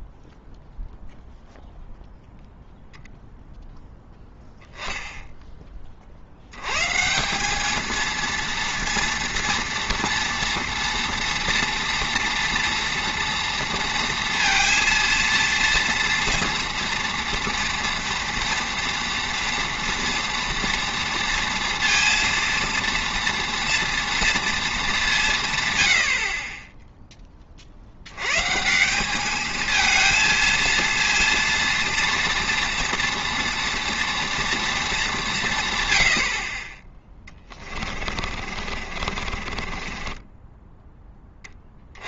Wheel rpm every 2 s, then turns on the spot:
0, 0, 0, 100, 230, 230, 230, 230, 230, 230, 230, 230, 230, 30, 150, 230, 230, 230, 40, 40, 10.
38-42